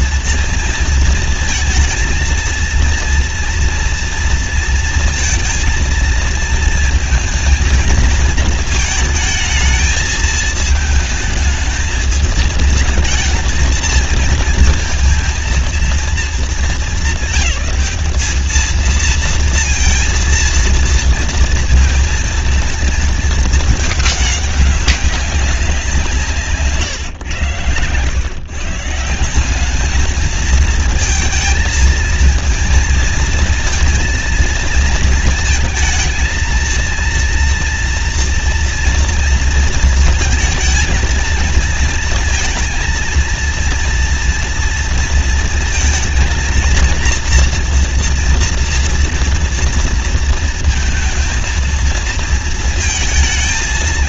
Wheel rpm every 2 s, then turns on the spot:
230, 230, 230, 230, 230, 220, 220, 220, 210, 220, 230, 230, 200, 140, 140, 230, 220, 230, 230, 230, 220, 230, 230, 230, 230, 230, 230.
26-28